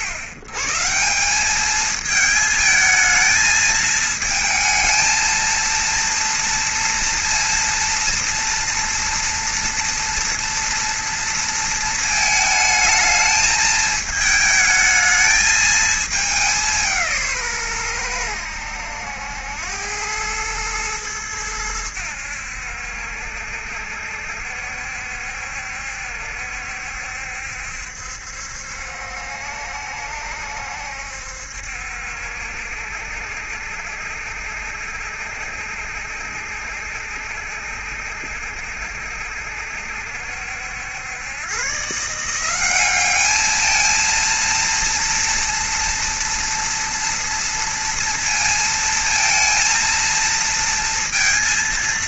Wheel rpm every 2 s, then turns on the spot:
120, 220, 220, 230, 230, 240, 220, 220, 190, 90, 110, 80, 70, 70, 70, 70, 70, 70, 70, 70, 80, 190, 230, 230, 230, 230.
none